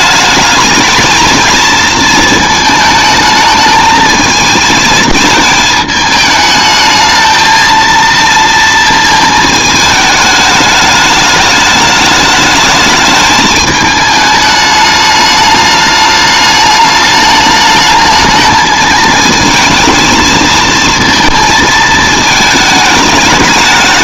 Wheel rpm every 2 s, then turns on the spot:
220, 220, 220, 220, 230, 210, 210, 210, 210, 220, 220, 220.
none